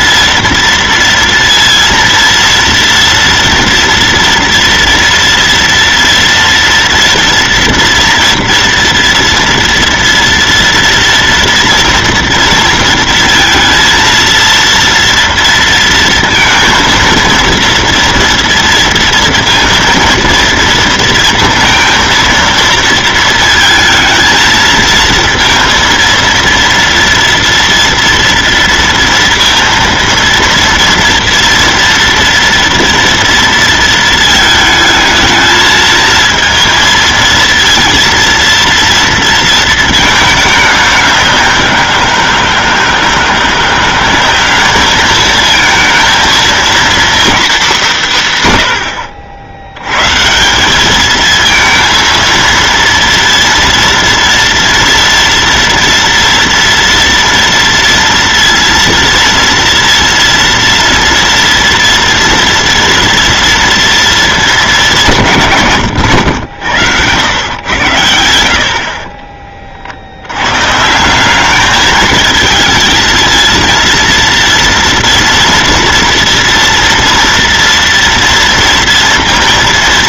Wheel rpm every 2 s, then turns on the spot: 230, 230, 230, 230, 240, 230, 230, 230, 230, 230, 230, 230, 230, 230, 230, 230, 230, 220, 230, 230, 200, 160, 200, 230, 140, 190, 230, 230, 230, 230, 230, 240, 210, 90, 80, 130, 220, 230, 230, 230.
none